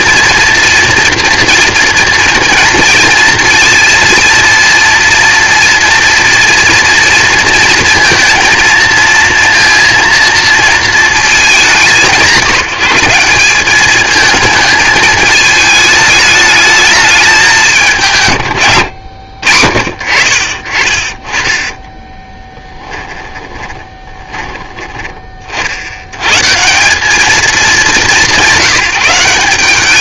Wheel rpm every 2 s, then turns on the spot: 230, 230, 230, 230, 230, 230, 180, 220, 210, 120, 40, 20, 20, 130, 180.
22-26